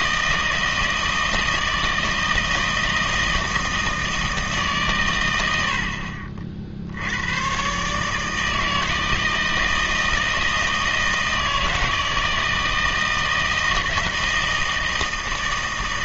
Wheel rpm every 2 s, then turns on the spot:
160, 160, 140, 50, 160, 160, 160, 160.
none